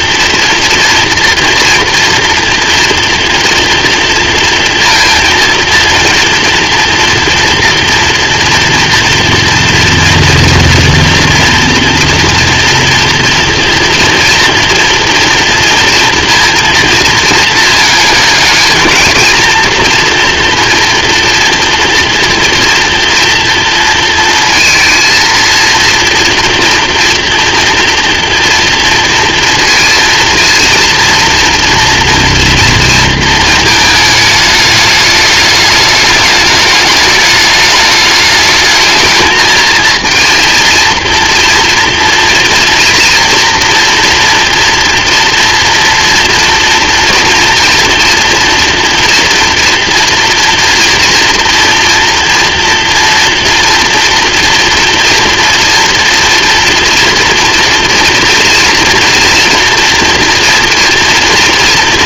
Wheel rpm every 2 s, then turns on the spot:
230, 240, 230, 230, 230, 240, 240, 230, 230, 220, 230, 230, 230, 230, 230, 230, 230, 210, 210, 220, 230, 230, 240, 230, 240, 230, 230, 240, 230, 230, 230.
none